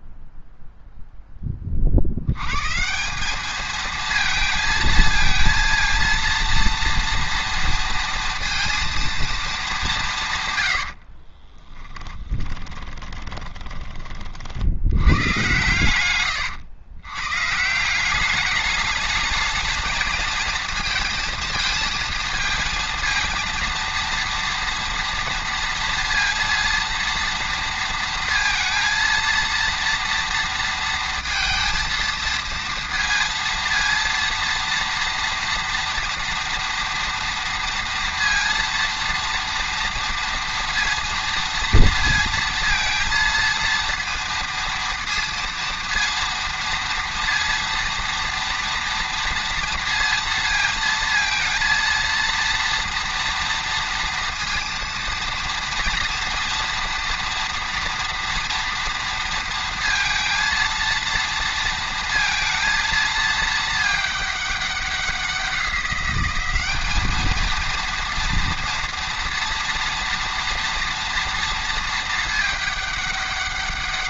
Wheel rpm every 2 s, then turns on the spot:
0, 150, 220, 230, 230, 100, 20, 80, 110, 210, 230, 230, 230, 230, 230, 230, 230, 230, 230, 230, 230, 230, 230, 230, 230, 230, 230, 230, 230, 230, 230, 230, 200, 200, 230, 230, 210.
10-14